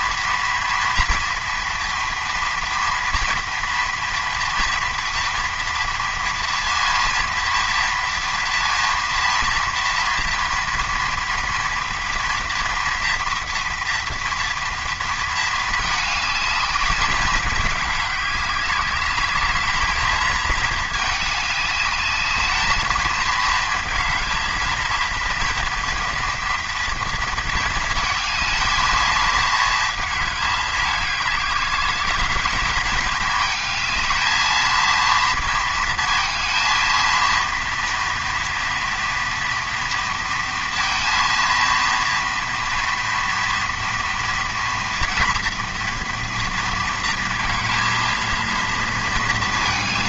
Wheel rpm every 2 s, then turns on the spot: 230, 230, 230, 230, 230, 230, 240, 230, 210, 200, 220, 210, 230, 230, 230, 210, 210, 230, 230, 230, 230, 230, 230, 230, 230.
none